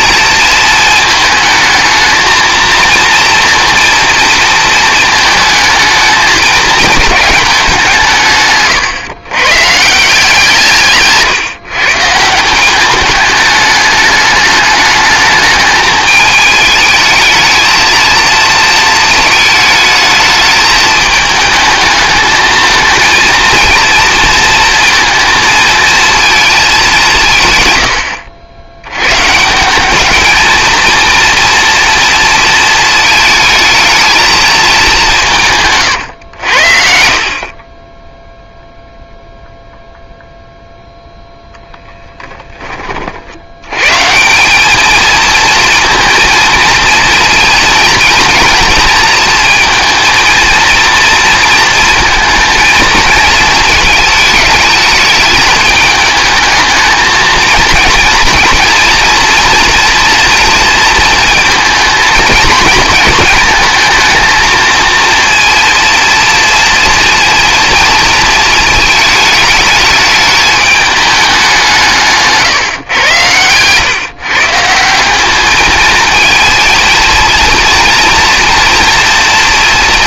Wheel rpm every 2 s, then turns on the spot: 230, 230, 230, 210, 130, 170, 190, 210, 210, 230, 210, 220, 230, 210, 80, 220, 230, 220, 80, 0, 0, 20, 190, 230, 230, 230, 230, 210, 220, 230, 230, 230, 230, 230, 220, 210, 140, 150, 220, 230.
8-10 72-74